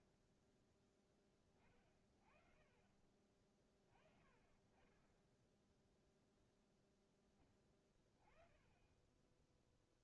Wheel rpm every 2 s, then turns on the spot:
10, 40, 30, 0, 20.
none